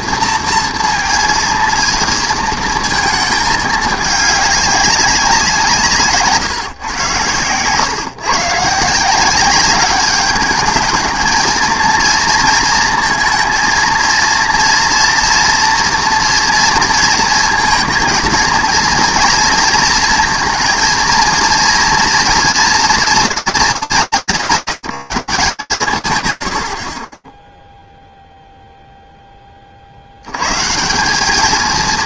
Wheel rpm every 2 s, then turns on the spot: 230, 230, 200, 140, 140, 210, 230, 230, 230, 230, 230, 230, 140, 110, 0, 140.
6-8